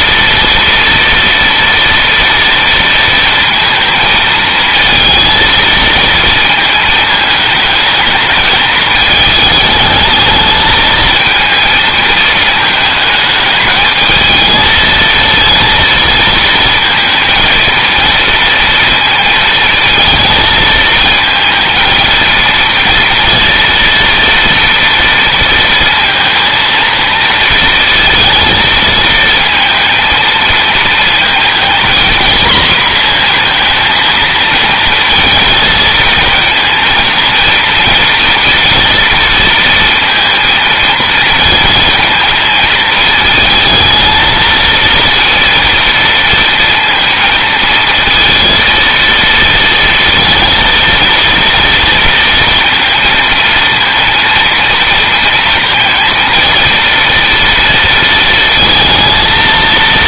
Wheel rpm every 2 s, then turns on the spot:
230, 230, 230, 220, 220, 220, 220, 220, 220, 230, 230, 230, 230, 230, 220, 230, 230, 230, 230, 230, 230, 230, 230, 230, 230, 230, 230, 230, 230, 220.
none